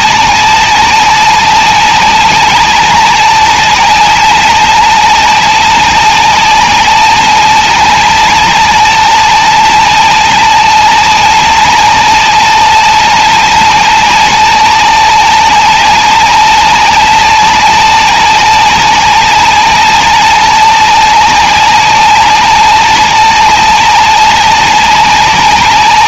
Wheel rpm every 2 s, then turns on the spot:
200, 190, 200, 200, 200, 200, 200, 190, 200, 200, 200, 200, 190.
none